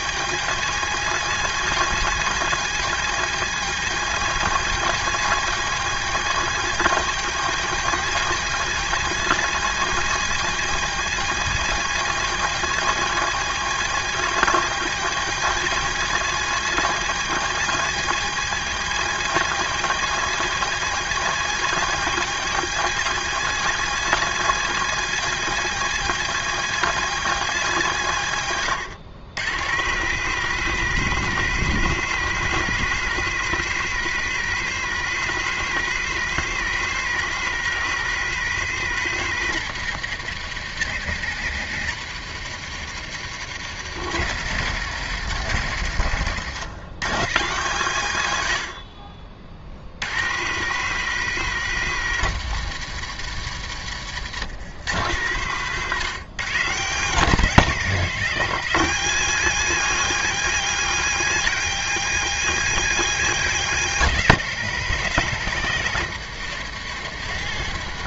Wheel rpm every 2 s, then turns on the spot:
200, 200, 200, 200, 200, 200, 200, 200, 200, 200, 200, 200, 200, 200, 130, 200, 200, 200, 200, 190, 160, 160, 140, 130, 60, 180, 150, 130, 140, 190, 200, 200, 160, 170.
28-30